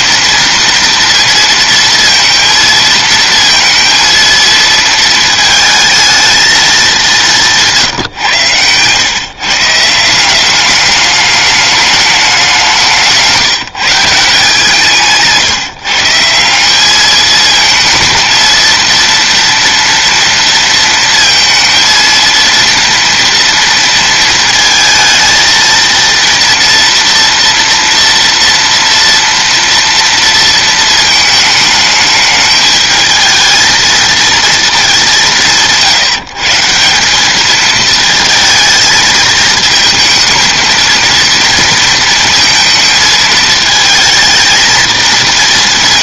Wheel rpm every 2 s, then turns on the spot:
230, 230, 230, 220, 120, 200, 190, 160, 190, 230, 230, 230, 230, 230, 230, 230, 220, 220, 160, 220, 220, 230, 220.
none